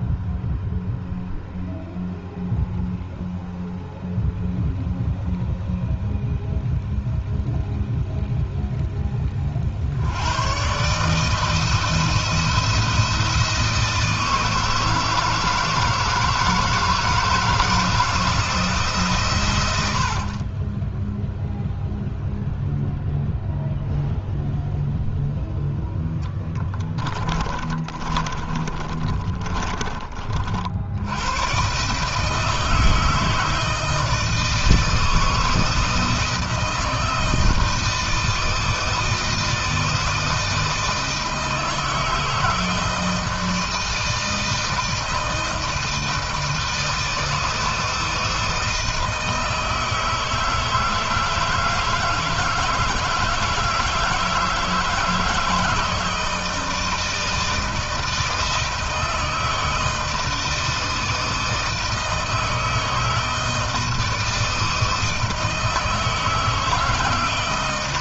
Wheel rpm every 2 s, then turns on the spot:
0, 0, 0, 0, 10, 130, 170, 160, 160, 160, 20, 0, 0, 10, 30, 60, 160, 160, 160, 160, 160, 160, 160, 160, 160, 160, 160, 160, 160, 160, 160, 160, 160, 160.
20-22 26-30